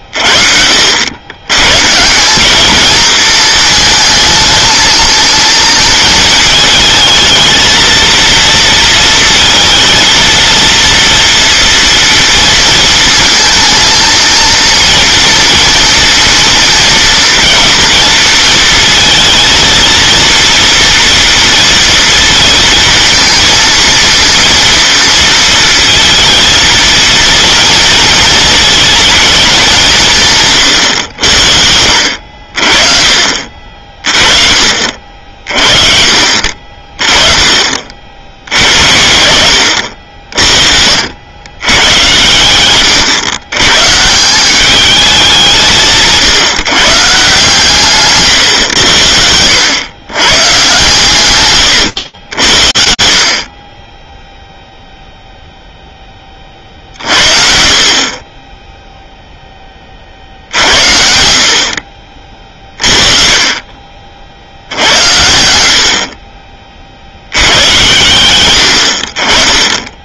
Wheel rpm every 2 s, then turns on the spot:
60, 210, 230, 220, 230, 230, 230, 230, 230, 230, 230, 230, 230, 230, 230, 120, 50, 50, 40, 70, 70, 120, 200, 160, 120, 130, 60, 0, 50, 0, 70, 40, 80, 30, 80.
40-42